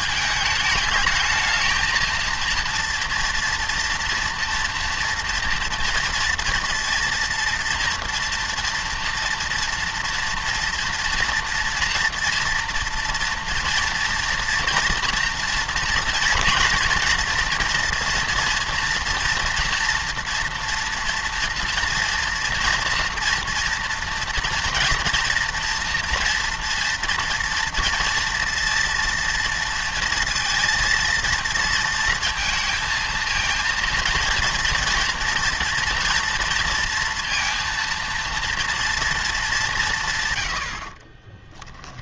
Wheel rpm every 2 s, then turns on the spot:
220, 230, 240, 230, 230, 230, 230, 230, 230, 230, 240, 230, 230, 230, 230, 230, 230, 230, 230, 230, 80.
none